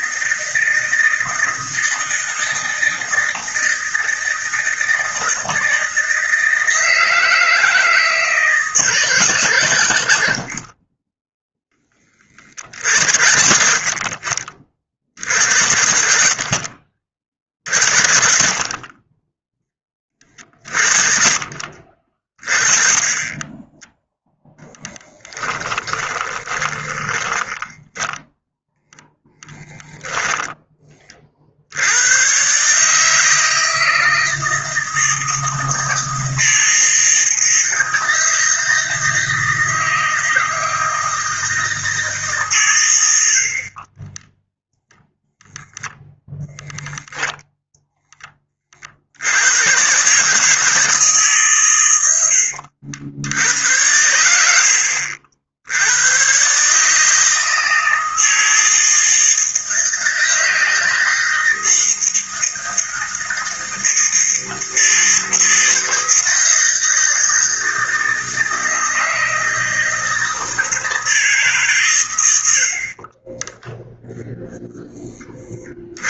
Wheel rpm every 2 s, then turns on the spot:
160, 160, 160, 160, 160, 40, 50, 50, 50, 40, 40, 20, 10, 30, 0, 20, 150, 160, 160, 160, 160, 100, 0, 0, 60, 150, 70, 60, 150, 160, 160, 160, 160, 160, 160, 160, 40, 10.
24-28